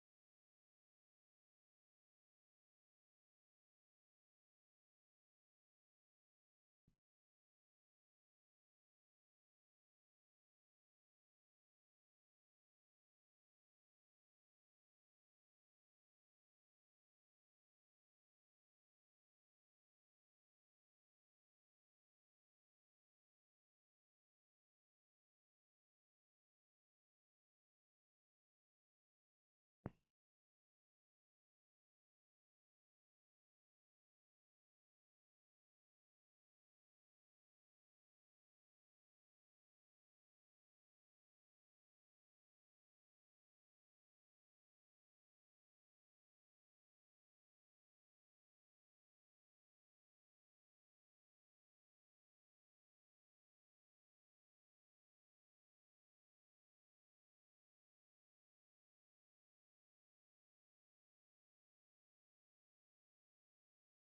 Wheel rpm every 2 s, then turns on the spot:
0, 0, 0, 0, 0, 0, 0, 0, 0, 0, 0, 0, 0, 0, 0, 0, 0, 0, 0, 0, 0, 0, 0, 0, 0, 0, 0, 0, 0, 0, 0, 0.
none